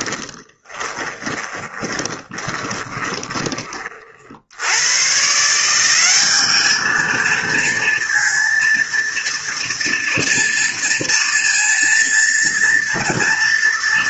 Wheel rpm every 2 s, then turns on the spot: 10, 20, 130, 220, 230, 230, 230.
0-4